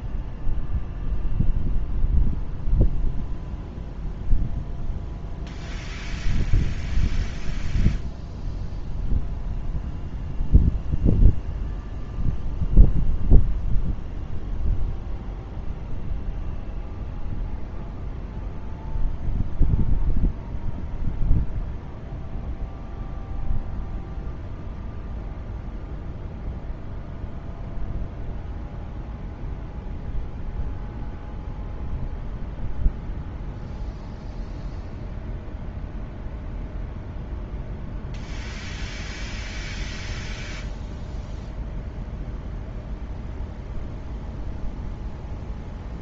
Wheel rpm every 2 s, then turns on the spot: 0, 0, 0, 0, 0, 0, 0, 0, 0, 0, 0, 0, 0, 0, 0, 0, 0, 0, 0, 0, 0, 0, 0.
none